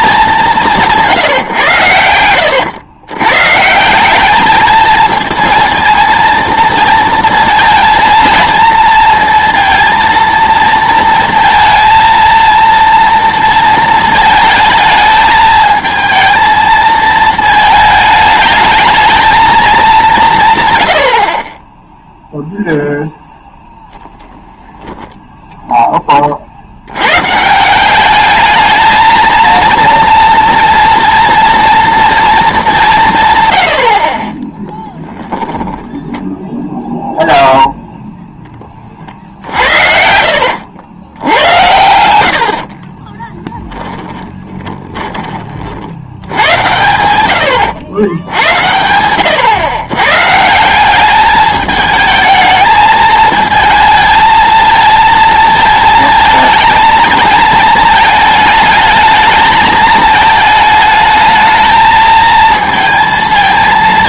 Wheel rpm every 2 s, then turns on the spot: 170, 100, 220, 230, 230, 220, 230, 220, 220, 220, 100, 0, 10, 70, 220, 230, 190, 10, 0, 30, 90, 50, 10, 100, 90, 170, 220, 220, 220, 220, 220, 230.
42-46